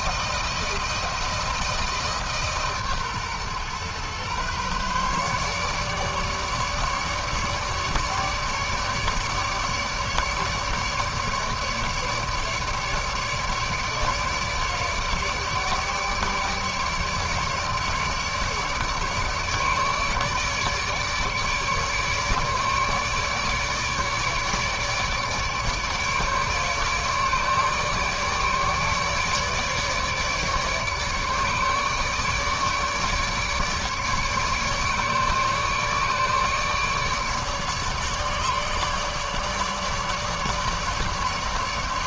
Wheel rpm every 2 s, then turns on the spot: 170, 140, 140, 150, 150, 150, 150, 150, 150, 150, 150, 150, 150, 150, 150, 150, 150, 150, 150, 150, 150.
none